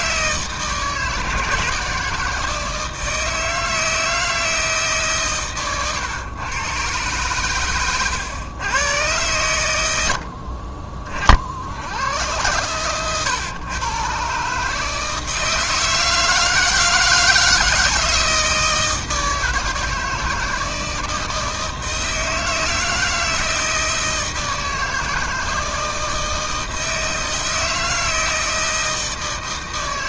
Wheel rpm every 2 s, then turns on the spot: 160, 160, 160, 120, 110, 50, 120, 140, 160, 160, 160, 160, 160, 160, 160.
10-12